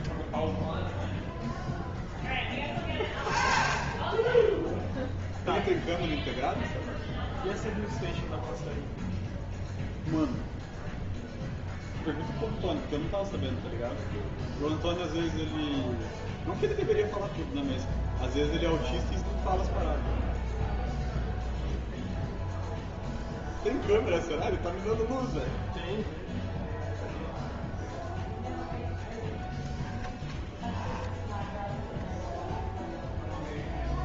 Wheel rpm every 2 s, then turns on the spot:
0, 10, 0, 0, 0, 0, 0, 0, 0, 0, 0, 0, 0, 0, 0, 10, 0.
none